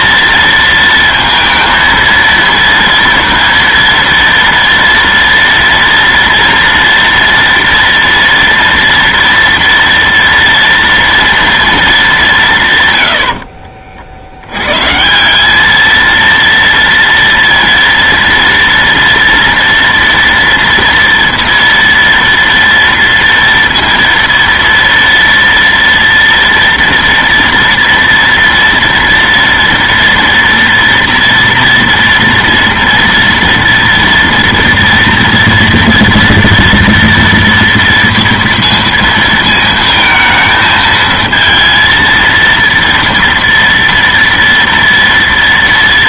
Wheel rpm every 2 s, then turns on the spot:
230, 230, 230, 230, 230, 230, 200, 60, 230, 230, 240, 230, 230, 230, 230, 230, 230, 240, 230, 230, 220, 230, 230.
none